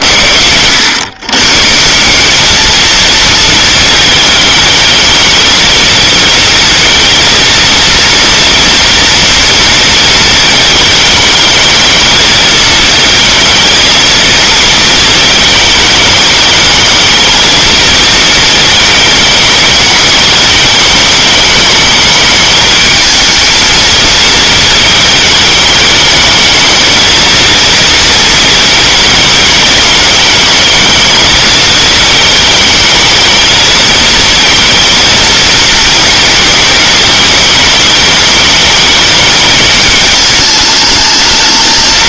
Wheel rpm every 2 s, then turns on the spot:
80, 210, 220, 220, 230, 220, 230, 220, 220, 220, 220, 210, 220, 220, 220, 230, 220, 230, 220, 220, 210.
none